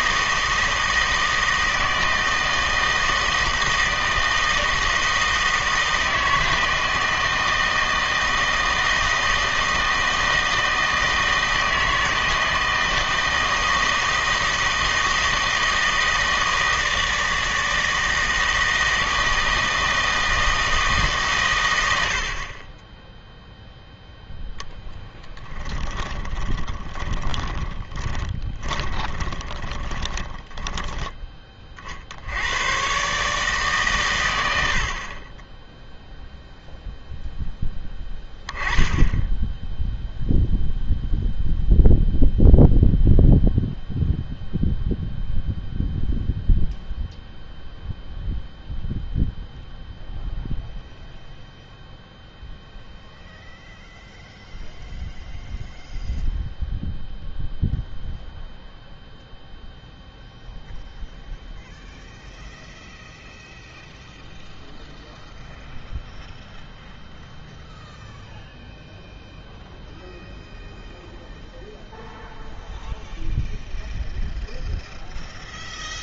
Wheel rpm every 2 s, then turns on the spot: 160, 160, 160, 160, 160, 160, 160, 160, 160, 160, 160, 20, 0, 20, 20, 10, 110, 80, 0, 10, 0, 0, 0, 0, 0, 0, 0, 0, 0, 0, 0, 0, 0, 0, 0, 0, 0, 0.
26-32